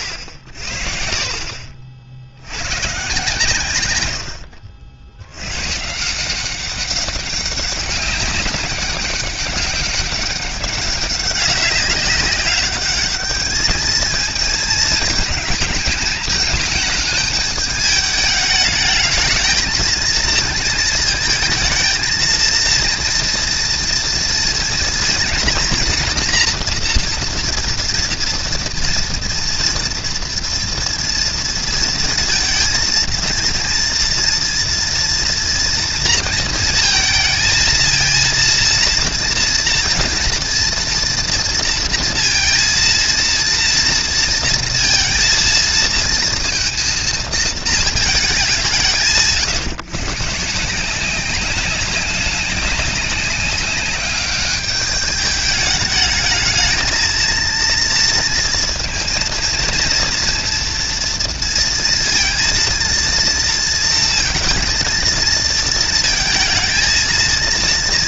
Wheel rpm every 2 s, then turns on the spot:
60, 100, 90, 190, 200, 200, 200, 220, 220, 220, 220, 230, 230, 240, 230, 230, 230, 230, 220, 230, 230, 230, 230, 230, 180, 150, 190, 200, 220, 230, 230, 230, 230, 220.
none